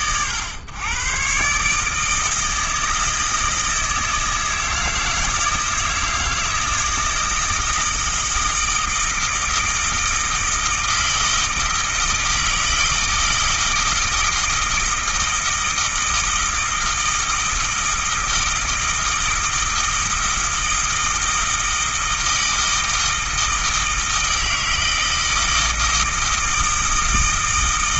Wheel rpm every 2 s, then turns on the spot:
120, 160, 160, 160, 160, 160, 160, 160, 160, 160, 160, 160, 160, 160.
none